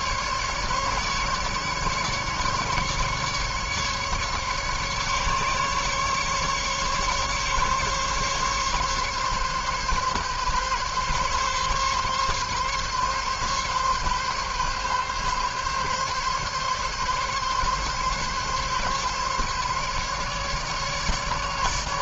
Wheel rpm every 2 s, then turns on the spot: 150, 150, 150, 150, 140, 140, 140, 140, 140, 140, 150.
none